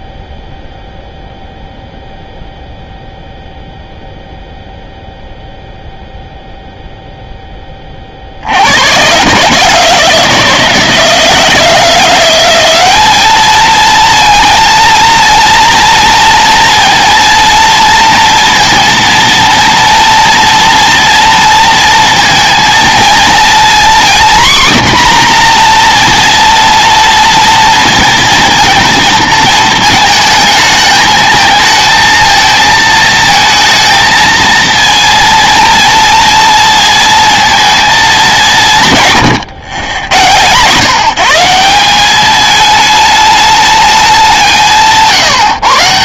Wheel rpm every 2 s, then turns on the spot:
0, 0, 0, 0, 90, 160, 190, 220, 230, 230, 230, 230, 250, 230, 220, 220, 230, 230, 230, 170, 140, 220, 170.
none